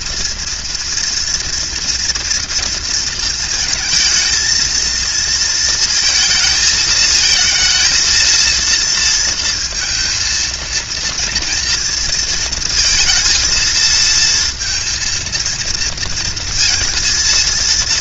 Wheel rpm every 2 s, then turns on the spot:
240, 230, 230, 220, 230, 230, 230, 230, 230.
none